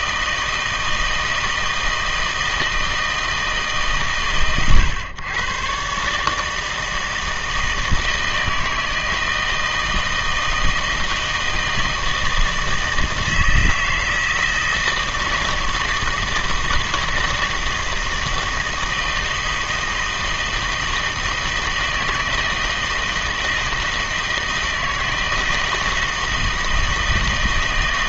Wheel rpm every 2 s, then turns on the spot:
160, 160, 130, 160, 160, 160, 160, 160, 160, 160, 160, 160, 160, 160.
none